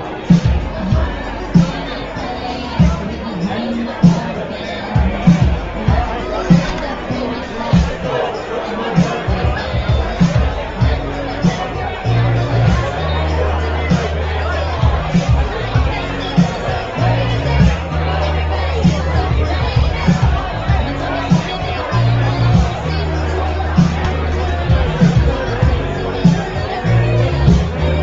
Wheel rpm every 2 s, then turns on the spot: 0, 0, 0, 0, 0, 0, 0, 0, 0, 0, 0, 0, 0, 0.
none